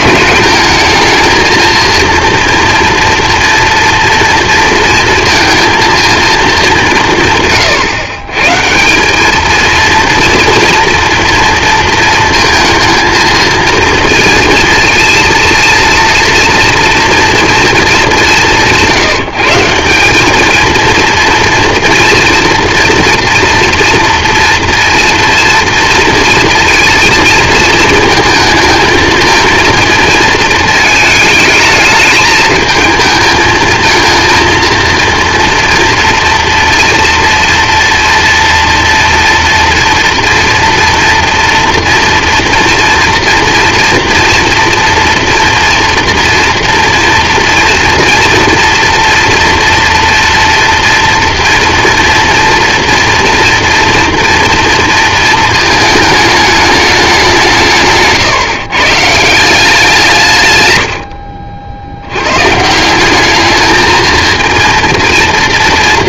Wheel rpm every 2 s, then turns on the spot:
220, 230, 230, 180, 170, 230, 230, 230, 230, 180, 230, 230, 230, 230, 220, 220, 220, 230, 230, 230, 230, 230, 230, 230, 230, 230, 240, 230, 210, 140, 100, 150, 220.
none